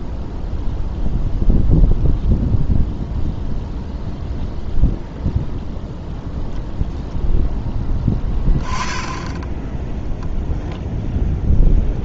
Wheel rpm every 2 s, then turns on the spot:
0, 0, 0, 0, 20, 0.
none